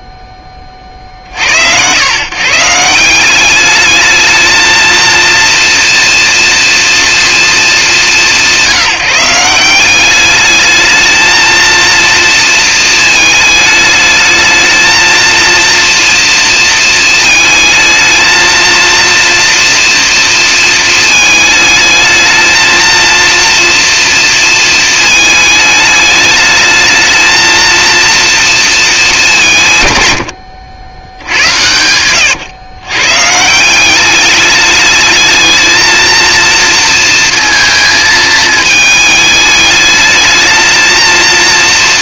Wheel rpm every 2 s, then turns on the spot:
30, 180, 230, 230, 170, 220, 230, 220, 230, 230, 230, 230, 220, 220, 220, 90, 120, 210, 230, 220, 220.
none